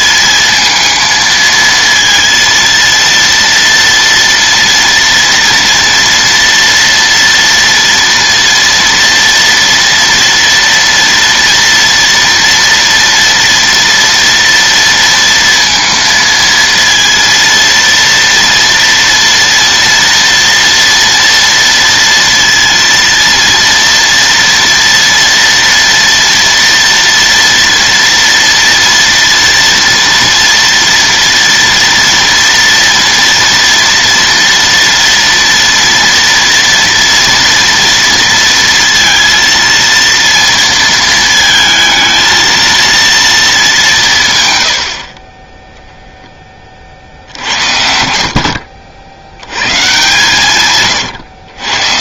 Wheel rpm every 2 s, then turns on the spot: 230, 230, 230, 230, 230, 230, 230, 230, 230, 230, 230, 230, 230, 230, 230, 230, 230, 230, 230, 230, 230, 230, 100, 30, 60, 140.
44-46